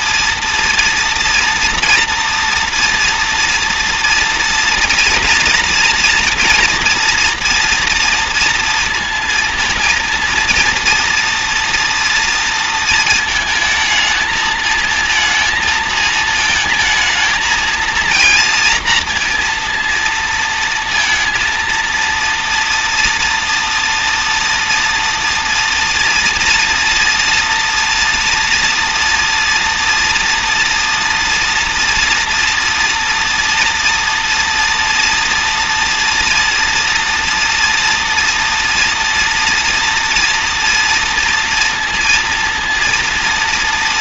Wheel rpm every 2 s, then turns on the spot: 230, 230, 230, 230, 230, 230, 230, 220, 230, 230, 230, 230, 230, 230, 230, 230, 230, 230, 230, 230, 240, 230.
none